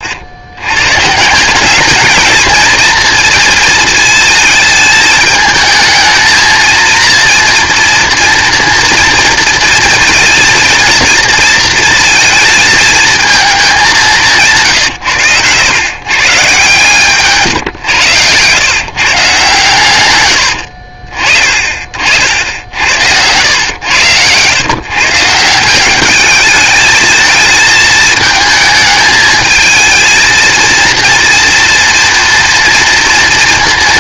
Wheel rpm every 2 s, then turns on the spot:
120, 230, 220, 230, 230, 230, 220, 140, 140, 140, 60, 80, 130, 210, 220, 230, 230.
14-16